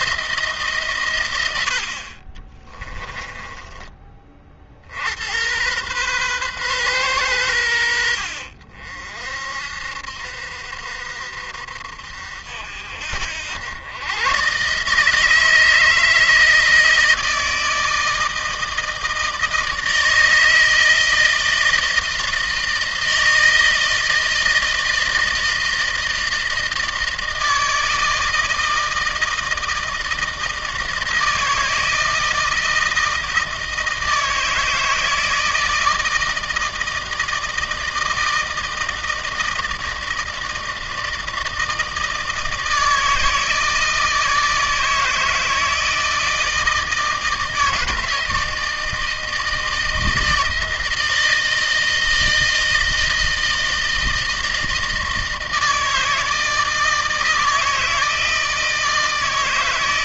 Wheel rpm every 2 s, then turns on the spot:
140, 30, 60, 120, 60, 60, 60, 140, 160, 160, 160, 160, 160, 160, 160, 160, 160, 160, 160, 160, 160, 160, 160, 160, 160, 160, 160, 160, 160, 160.
2-4